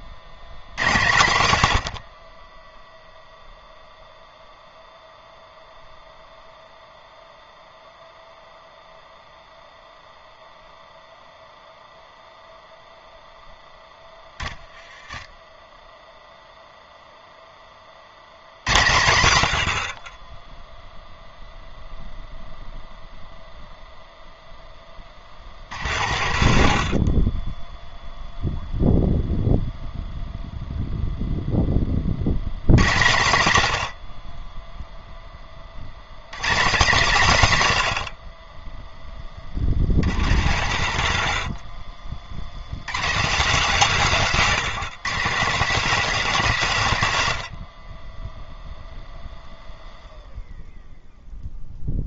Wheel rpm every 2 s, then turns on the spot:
100, 10, 0, 0, 0, 0, 0, 10, 0, 110, 0, 0, 20, 60, 0, 0, 130, 10, 180, 10, 90, 120, 200, 160, 0, 0.
0-2 24-28 40-42